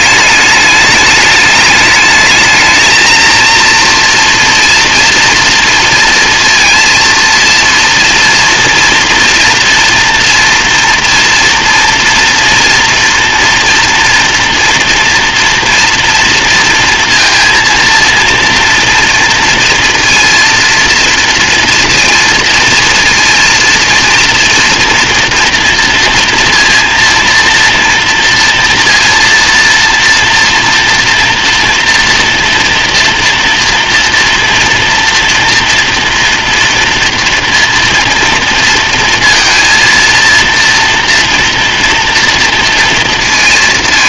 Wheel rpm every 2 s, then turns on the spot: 210, 220, 230, 230, 230, 230, 240, 240, 230, 230, 230, 230, 240, 230, 230, 240, 230, 230, 230, 230, 230, 230.
none